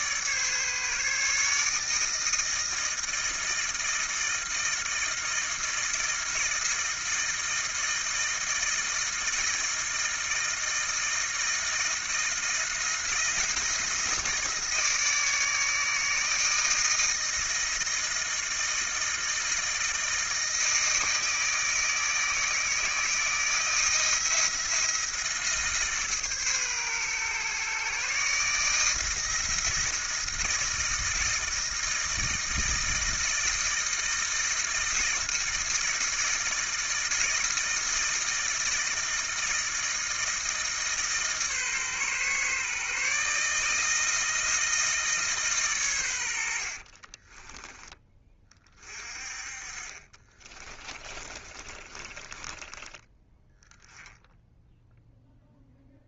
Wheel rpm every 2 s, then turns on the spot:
150, 160, 160, 160, 160, 160, 170, 160, 160, 160, 160, 160, 170, 150, 150, 160, 160, 160, 160, 160, 160, 140, 160, 100, 20, 30, 20, 0.
50-54